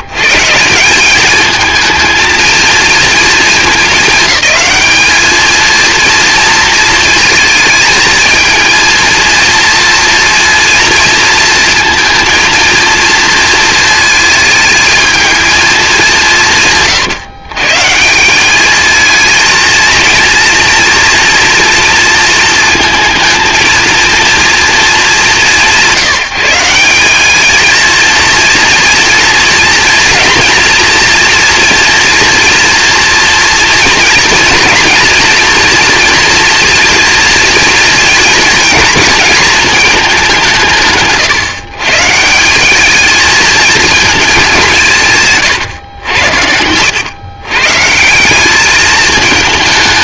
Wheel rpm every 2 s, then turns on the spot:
170, 220, 210, 230, 220, 230, 230, 220, 170, 200, 230, 230, 230, 170, 230, 230, 230, 230, 240, 230, 180, 190, 200, 90, 200.
none